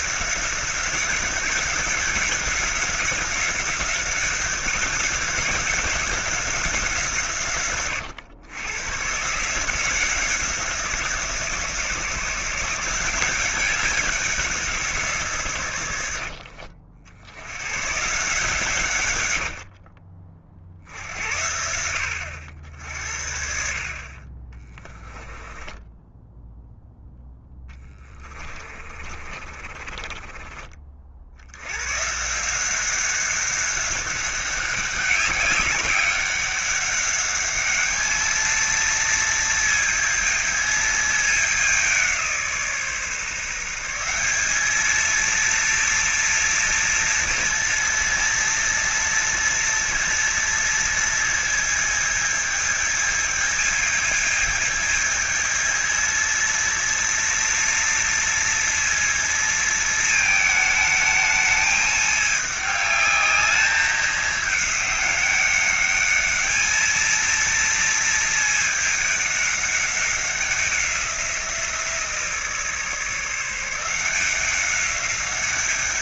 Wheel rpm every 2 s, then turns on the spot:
190, 190, 190, 170, 120, 170, 170, 170, 70, 130, 50, 70, 20, 0, 30, 40, 180, 190, 200, 230, 220, 150, 220, 230, 230, 230, 220, 220, 230, 230, 220, 210, 210, 220, 210, 180, 150, 190.
24-26 28-30